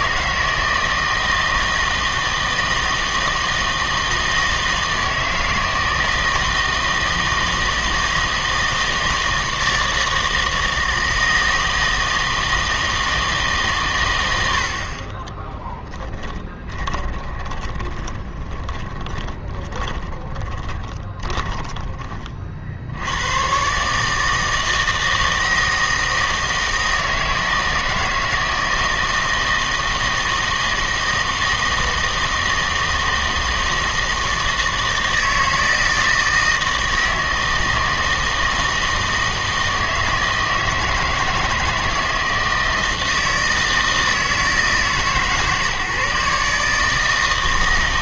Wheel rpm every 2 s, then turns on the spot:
160, 160, 160, 160, 160, 160, 160, 60, 20, 20, 20, 60, 160, 160, 160, 160, 160, 160, 160, 160, 160, 160, 160, 150.
16-22